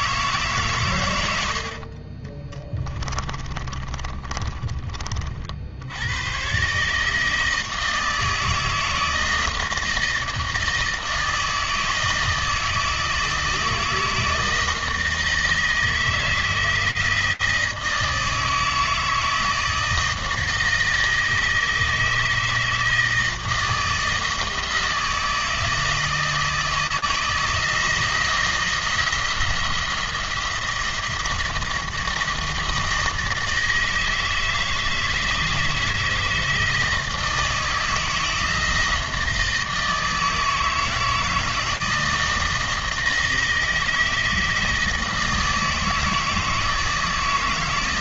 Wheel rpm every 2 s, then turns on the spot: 120, 30, 40, 140, 160, 160, 160, 160, 160, 160, 160, 160, 160, 160, 160, 170, 160, 160, 160, 160, 160, 160, 160, 160.
2-4